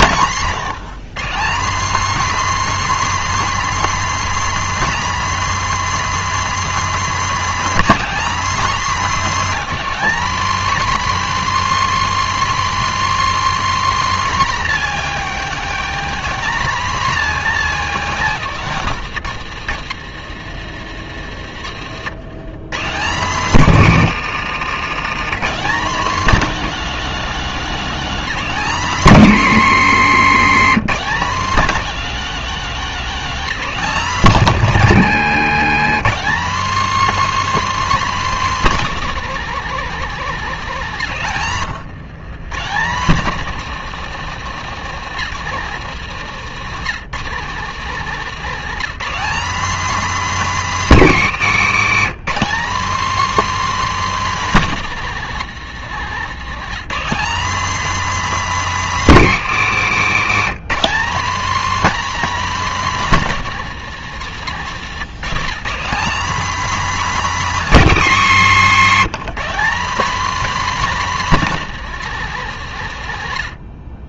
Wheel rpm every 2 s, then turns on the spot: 180, 300, 300, 290, 270, 300, 290, 270, 280, 210, 130, 160, 190, 260, 210, 210, 250, 170, 270, 260, 190, 170, 190, 180, 220, 230, 260, 220, 210, 240, 240, 230, 170, 260, 170, 260, 140.
24-26 40-42 64-66